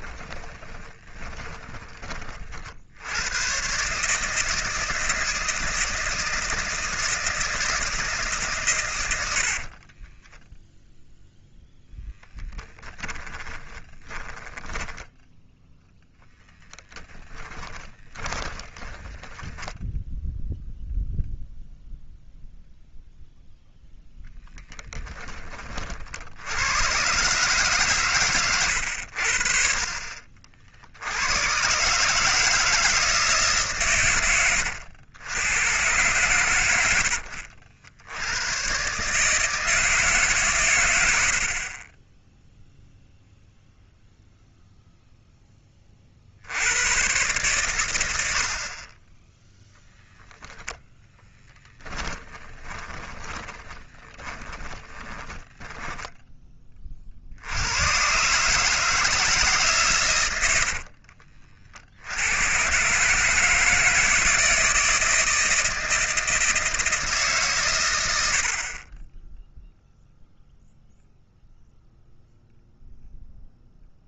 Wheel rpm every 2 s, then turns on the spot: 20, 70, 160, 160, 120, 0, 20, 10, 10, 20, 0, 0, 10, 110, 90, 70, 160, 90, 80, 130, 120, 0, 0, 100, 30, 10, 10, 20, 30, 160, 60, 130, 160, 160, 30, 0, 0.
0-2 12-20 24-26 52-56 60-62